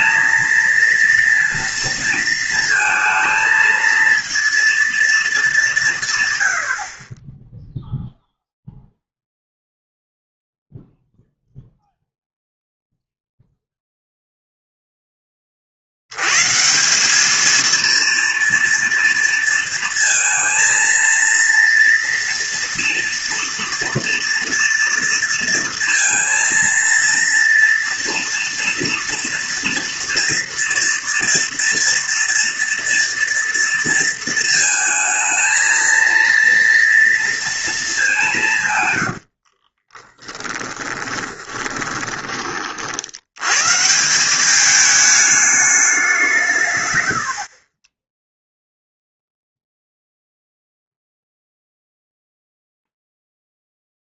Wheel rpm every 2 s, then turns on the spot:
230, 230, 230, 80, 0, 0, 0, 0, 150, 240, 230, 230, 230, 230, 230, 230, 230, 220, 230, 140, 20, 40, 210, 140, 0, 0, 0.
40-42